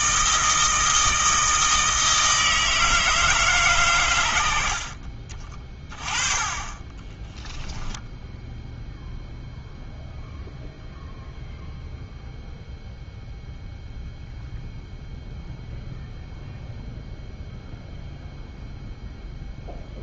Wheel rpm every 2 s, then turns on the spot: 160, 160, 50, 20, 0, 0, 0, 0, 0, 0.
none